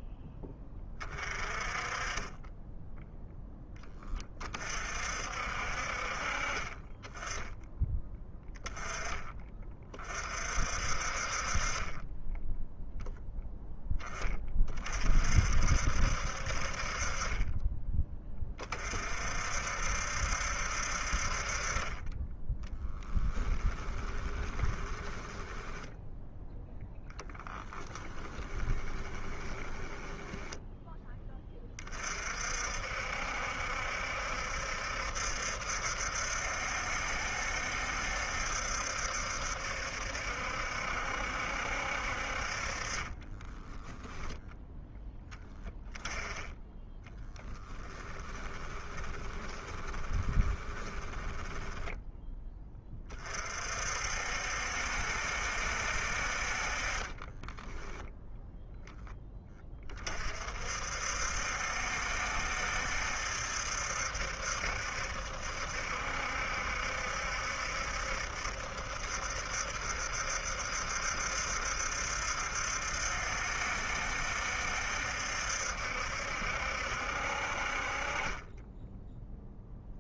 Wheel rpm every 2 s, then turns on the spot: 30, 10, 50, 10, 20, 50, 0, 40, 30, 50, 50, 10, 10, 10, 20, 10, 60, 70, 70, 70, 70, 30, 0, 20, 20, 20, 30, 60, 30, 20, 60, 70, 70, 70, 70, 70, 70, 70, 60, 10.
22-26 28-30 42-44 46-52 56-58